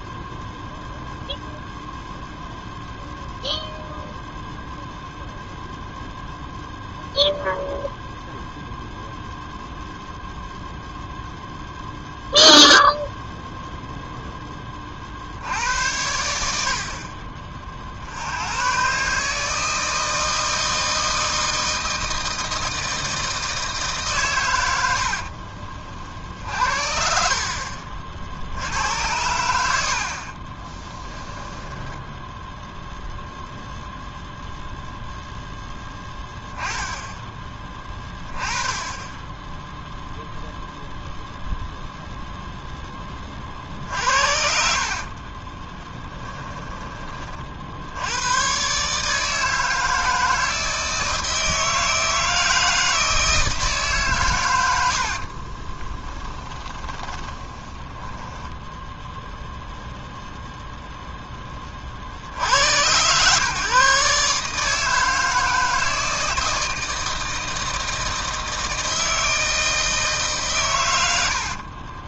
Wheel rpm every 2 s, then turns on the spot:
0, 0, 0, 0, 0, 0, 0, 50, 40, 130, 160, 160, 80, 50, 90, 10, 0, 0, 10, 10, 0, 10, 50, 30, 150, 160, 160, 70, 20, 0, 0, 120, 160, 160, 160, 100.
24-26 30-32 44-46 54-58